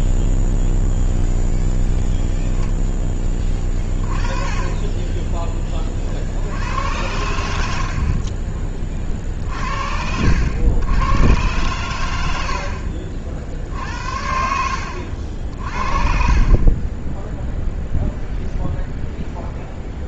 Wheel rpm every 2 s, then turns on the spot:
0, 0, 20, 70, 30, 80, 70, 70, 30, 0.
none